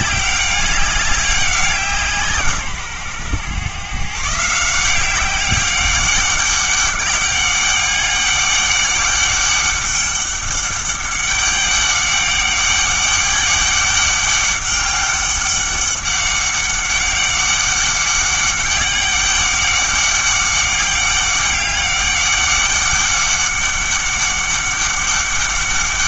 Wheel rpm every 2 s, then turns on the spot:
200, 140, 170, 200, 200, 200, 200, 200, 200, 200, 200, 200, 200.
none